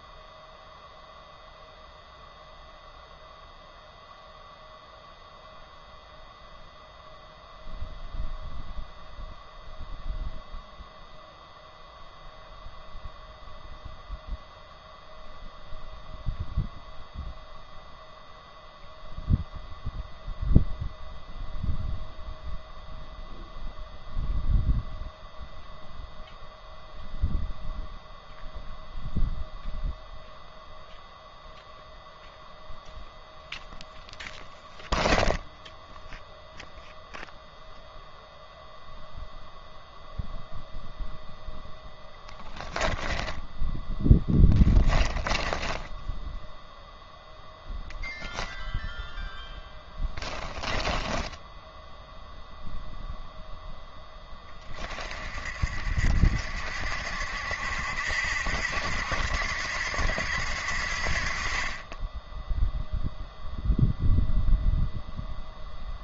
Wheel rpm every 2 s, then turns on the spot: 0, 0, 0, 0, 0, 0, 0, 0, 0, 0, 0, 0, 0, 0, 0, 0, 0, 0, 0, 0, 0, 10, 10, 0, 0, 20, 0, 30, 60, 80, 70, 0, 0.
42-46 50-52